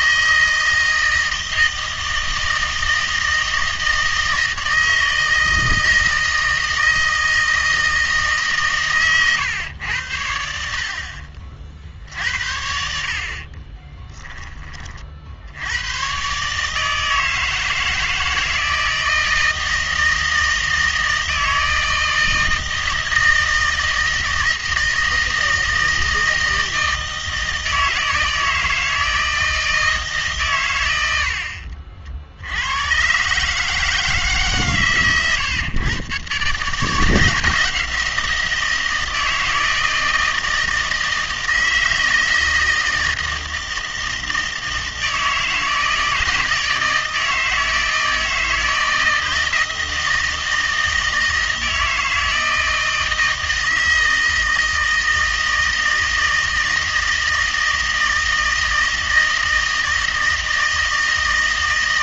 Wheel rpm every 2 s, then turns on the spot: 160, 160, 160, 160, 140, 60, 70, 30, 150, 160, 160, 160, 160, 160, 160, 110, 80, 140, 140, 170, 160, 160, 160, 160, 160, 160, 160, 160, 160, 160, 160.
none